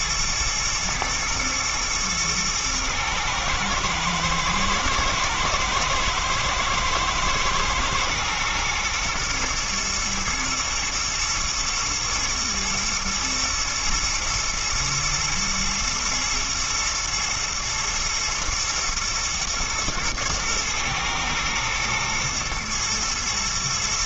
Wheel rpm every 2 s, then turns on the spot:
120, 110, 110, 110, 120, 120, 110, 120, 110, 120, 110, 110.
none